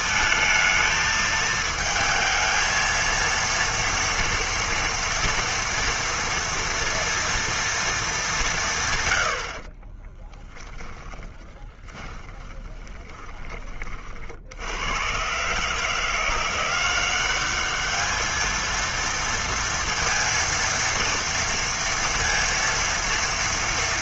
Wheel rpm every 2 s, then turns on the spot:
220, 230, 230, 230, 150, 20, 20, 80, 180, 230, 230, 230.
10-14